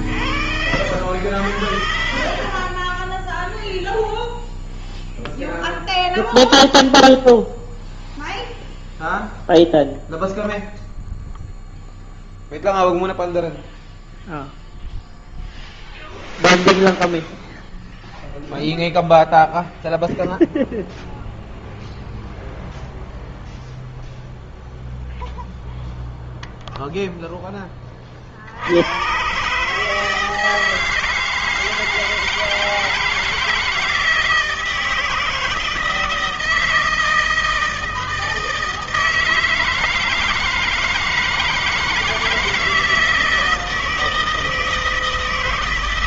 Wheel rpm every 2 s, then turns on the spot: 60, 50, 0, 0, 0, 0, 0, 0, 0, 0, 0, 0, 0, 0, 30, 150, 160, 160, 160, 160, 160, 160, 160.
none